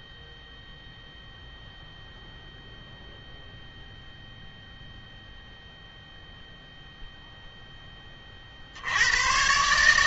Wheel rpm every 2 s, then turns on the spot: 0, 0, 0, 0, 70.
none